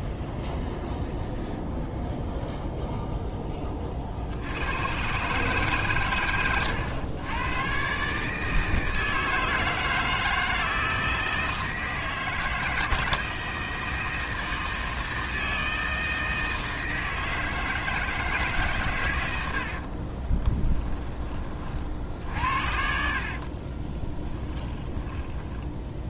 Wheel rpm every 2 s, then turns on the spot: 0, 0, 110, 100, 160, 160, 160, 160, 160, 130, 20, 70, 10.
20-26